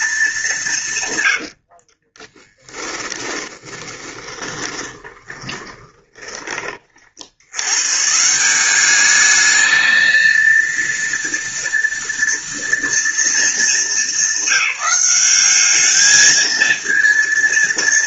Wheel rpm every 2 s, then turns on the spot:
120, 30, 20, 90, 210, 230, 230, 190, 230.
0-6